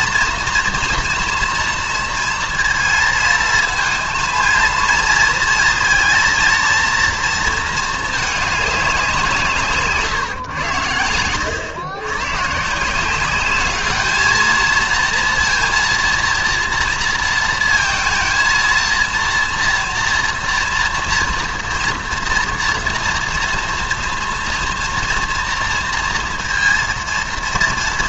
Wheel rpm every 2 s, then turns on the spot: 240, 230, 230, 230, 200, 110, 150, 220, 230, 230, 240, 230, 230, 230.
none